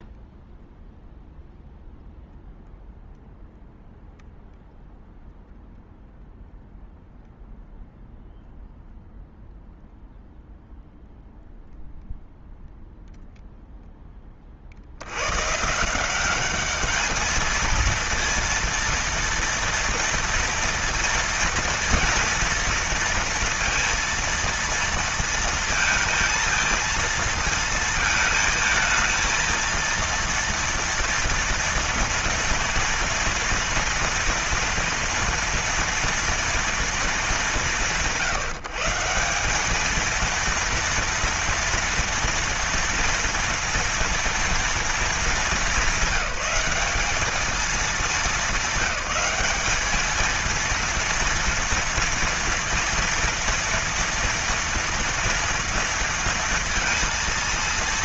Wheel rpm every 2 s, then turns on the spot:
0, 0, 0, 0, 0, 0, 0, 70, 210, 230, 230, 230, 230, 230, 220, 230, 230, 230, 200, 160, 230, 240, 230, 200, 200, 230, 230, 230, 230.
none